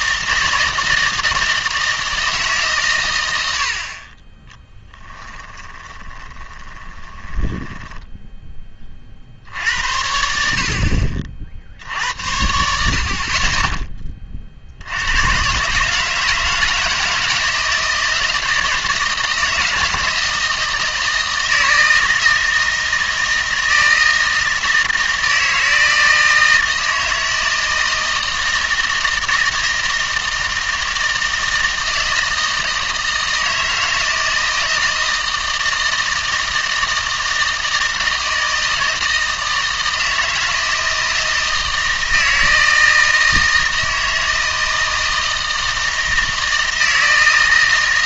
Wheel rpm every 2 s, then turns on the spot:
160, 140, 10, 20, 20, 60, 70, 70, 160, 160, 160, 160, 160, 160, 160, 160, 160, 160, 160, 160, 160, 160, 160, 160.
4-8